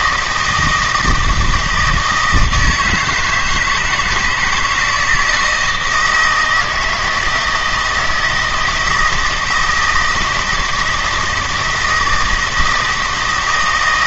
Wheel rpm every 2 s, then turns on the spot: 160, 160, 160, 170, 160, 160, 160.
none